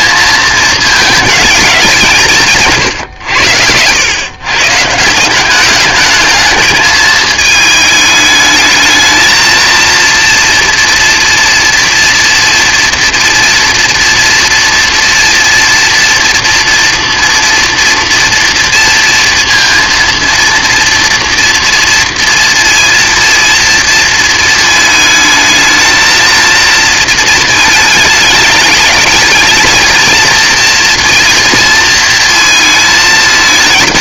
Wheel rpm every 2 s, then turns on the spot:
220, 150, 130, 220, 220, 230, 230, 230, 230, 230, 230, 230, 220, 230, 210, 230, 220.
none